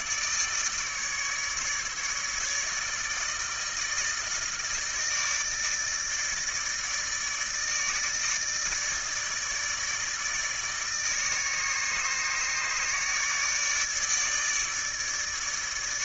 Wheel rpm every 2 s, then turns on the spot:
150, 150, 160, 150, 150, 150, 150, 150.
none